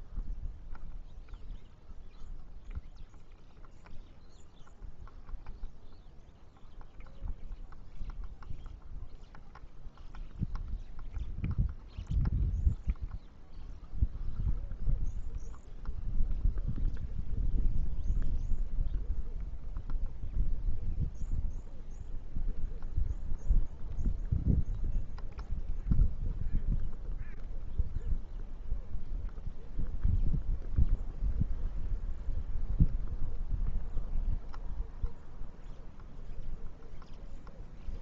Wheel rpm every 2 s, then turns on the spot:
0, 0, 0, 0, 0, 0, 0, 0, 0, 0, 0, 0, 0, 0, 0, 0, 0, 0, 0.
none